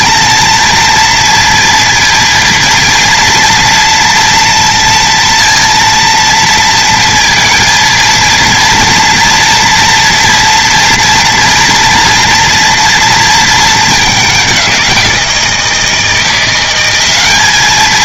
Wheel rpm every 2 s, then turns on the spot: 230, 230, 230, 230, 230, 230, 230, 190, 180.
none